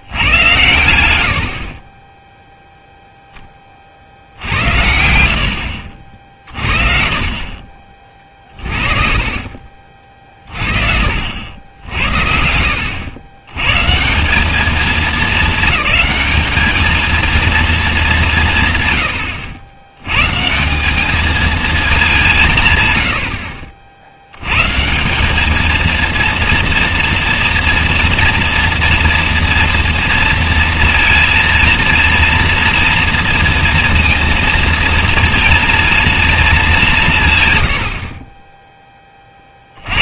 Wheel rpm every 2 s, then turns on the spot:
110, 0, 70, 40, 40, 50, 80, 210, 220, 150, 170, 140, 130, 230, 240, 230, 230, 230, 210, 20.
10-12